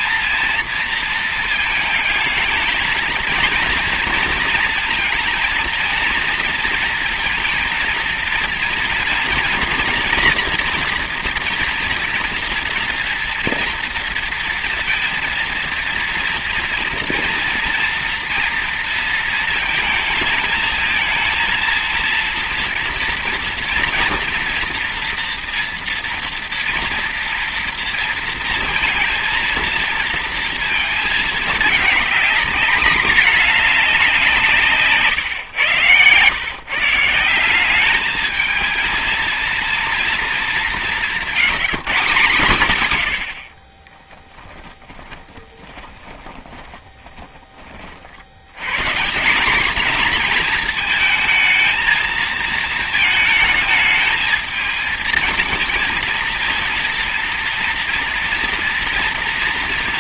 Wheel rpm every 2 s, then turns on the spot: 230, 220, 220, 230, 230, 230, 230, 230, 230, 230, 220, 230, 230, 230, 230, 220, 220, 140, 160, 220, 190, 90, 30, 20, 150, 220, 220, 220, 230, 230.
44-48